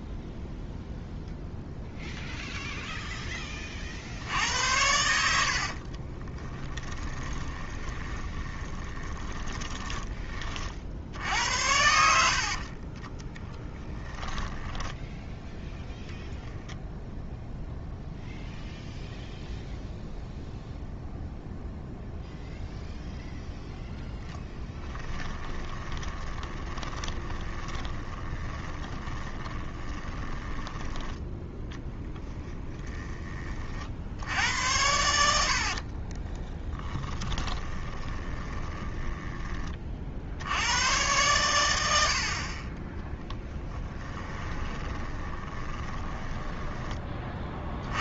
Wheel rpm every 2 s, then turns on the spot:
0, 0, 90, 10, 30, 50, 40, 10, 0, 0, 0, 0, 20, 20, 20, 10, 20, 90, 20, 10, 90, 20, 20, 20.
6-10 12-16 24-30 32-34 36-40 44-46